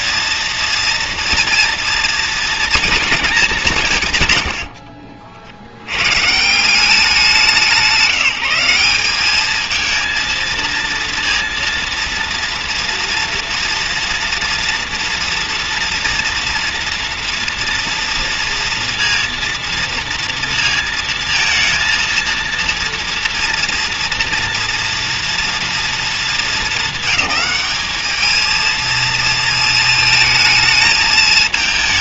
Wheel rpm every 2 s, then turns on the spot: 230, 230, 90, 140, 170, 230, 230, 240, 240, 230, 230, 230, 230, 220, 220, 220.
none